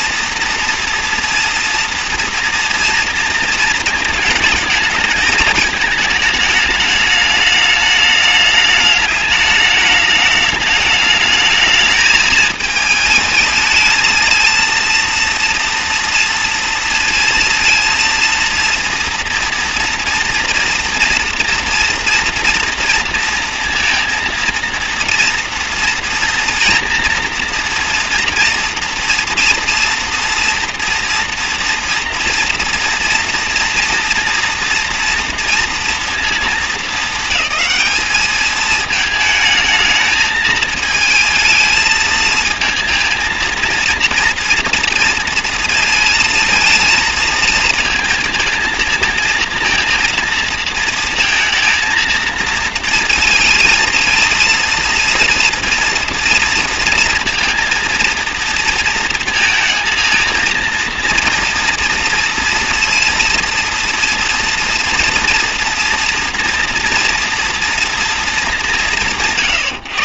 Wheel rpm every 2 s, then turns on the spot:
230, 230, 220, 210, 210, 210, 220, 230, 230, 230, 230, 230, 230, 230, 230, 240, 230, 240, 220, 220, 220, 230, 230, 220, 220, 230, 230, 230, 230, 230, 240, 230, 230, 230, 160.
none